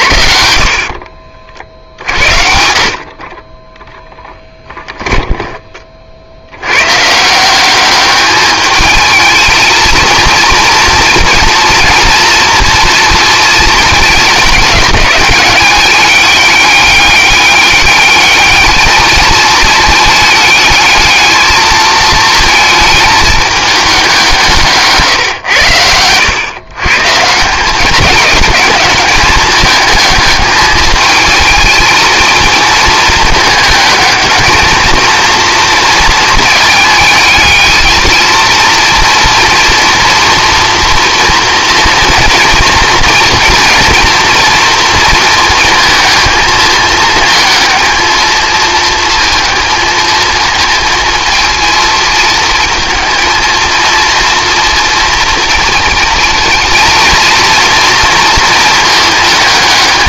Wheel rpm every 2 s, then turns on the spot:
50, 60, 10, 100, 210, 230, 230, 200, 200, 210, 220, 220, 150, 130, 210, 210, 230, 220, 220, 230, 230, 230, 230, 220, 220, 230, 220, 230, 230, 220.
4-6